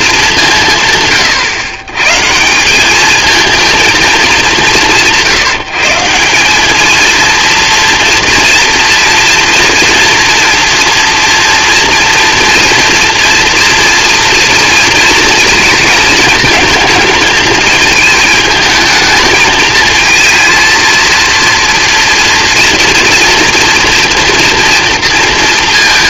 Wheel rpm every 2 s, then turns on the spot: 160, 180, 190, 200, 230, 230, 230, 230, 220, 220, 230, 230, 230.
none